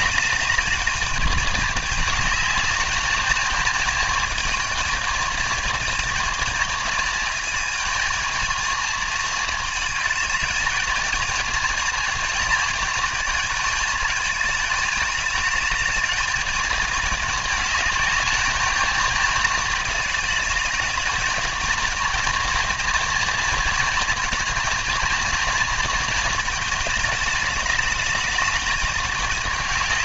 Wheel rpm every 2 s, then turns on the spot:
210, 210, 220, 220, 220, 220, 220, 210, 220, 210, 210, 220, 220, 220, 210.
none